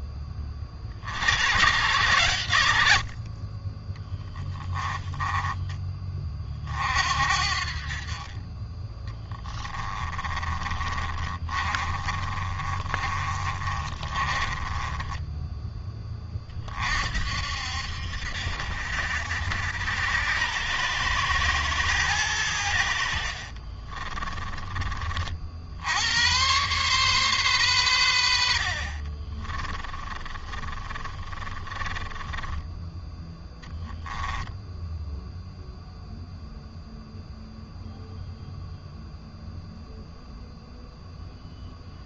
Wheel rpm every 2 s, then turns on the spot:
50, 100, 10, 50, 30, 30, 20, 20, 40, 70, 100, 80, 30, 120, 50, 30, 10, 0, 0, 0, 0.
4-6 8-16 28-32